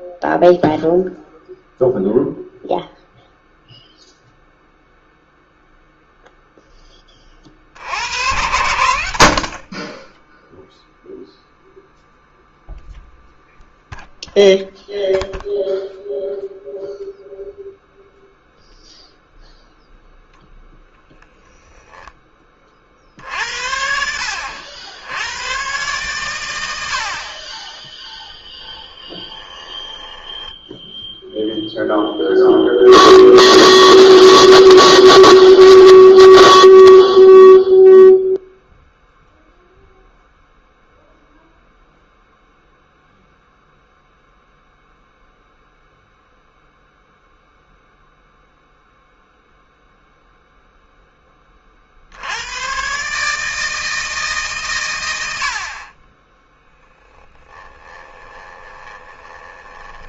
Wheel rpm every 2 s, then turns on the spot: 0, 0, 0, 10, 80, 0, 0, 0, 0, 0, 0, 40, 90, 100, 10, 10, 0, 0, 0, 0, 0, 0, 0, 0, 0, 0, 110, 130, 10, 20.
28-32 56-60